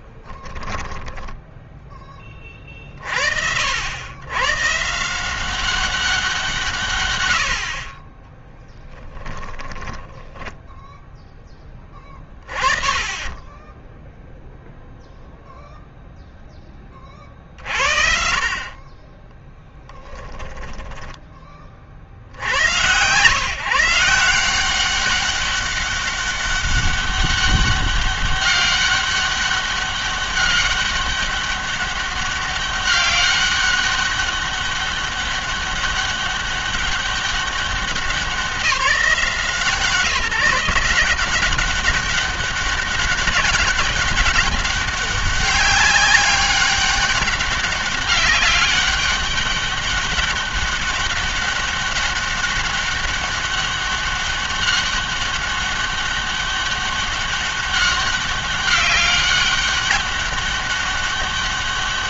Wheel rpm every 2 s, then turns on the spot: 10, 30, 140, 150, 10, 10, 20, 0, 20, 40, 10, 100, 180, 200, 200, 200, 200, 200, 200, 180, 170, 200, 190, 200, 200, 200, 200, 200, 200, 200, 200.
0-2 8-10 20-22